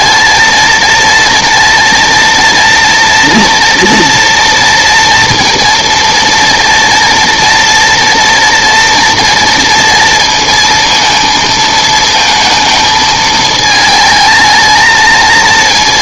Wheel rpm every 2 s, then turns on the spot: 230, 230, 230, 230, 230, 230, 220, 220.
none